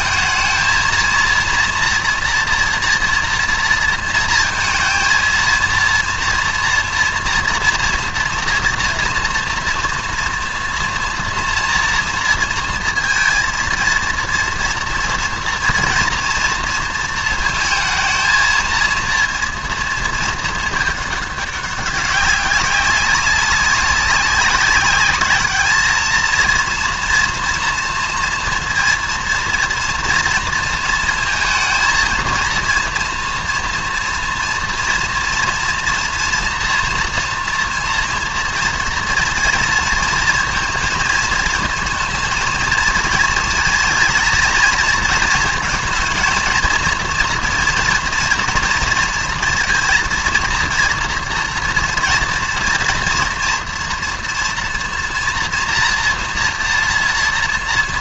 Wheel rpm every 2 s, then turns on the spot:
220, 230, 230, 230, 230, 240, 230, 230, 230, 230, 220, 200, 200, 230, 230, 230, 230, 230, 230, 230, 230, 230, 230, 230, 230, 230, 230, 230, 230.
none